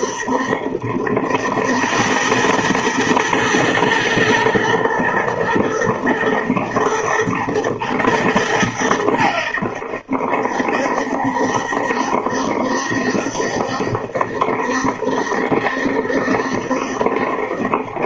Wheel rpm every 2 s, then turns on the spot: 70, 110, 110, 120, 100, 70, 70, 70, 70.
none